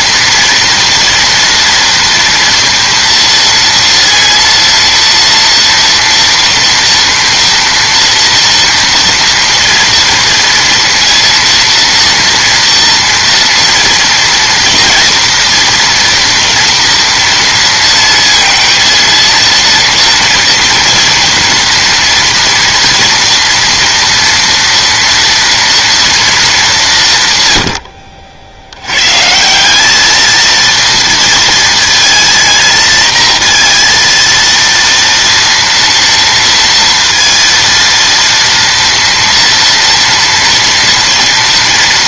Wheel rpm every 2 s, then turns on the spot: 230, 230, 230, 230, 230, 230, 230, 230, 230, 230, 230, 240, 230, 190, 90, 220, 230, 230, 230, 230, 230.
none